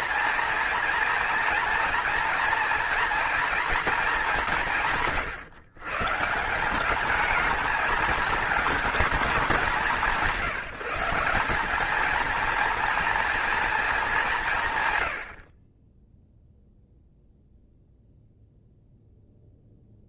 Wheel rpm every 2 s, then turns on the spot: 230, 230, 160, 200, 220, 180, 230, 110, 0, 0.
none